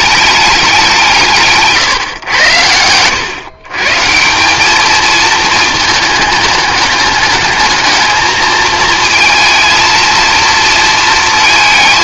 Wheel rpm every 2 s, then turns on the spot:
180, 100, 210, 210, 220, 230.
2-4